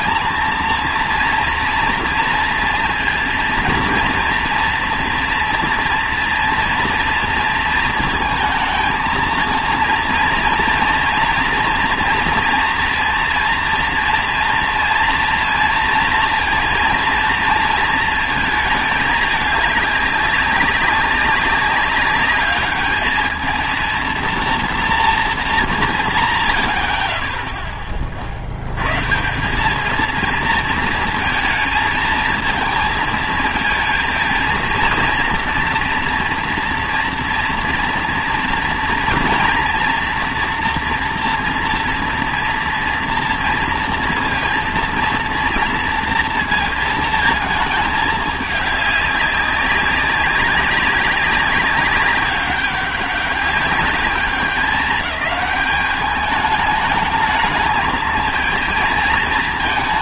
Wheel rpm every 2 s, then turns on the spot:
230, 230, 230, 230, 220, 230, 230, 240, 230, 220, 200, 210, 230, 60, 90, 230, 220, 230, 240, 230, 240, 230, 240, 230, 210, 200, 200, 200, 210, 220.
none